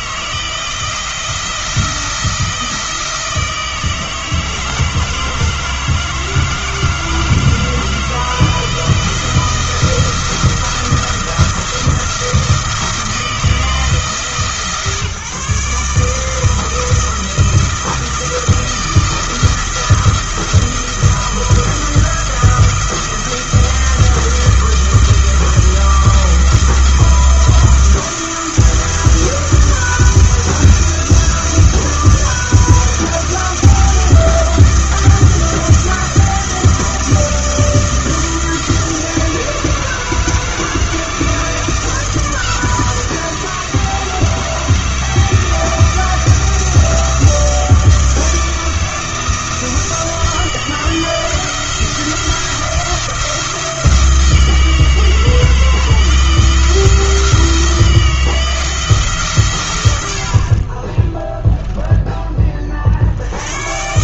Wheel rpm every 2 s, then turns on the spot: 170, 160, 160, 160, 160, 170, 160, 140, 170, 170, 170, 170, 170, 170, 170, 170, 170, 170, 170, 160, 160, 160, 160, 170, 170, 160, 170, 160, 170, 160, 30, 40.
none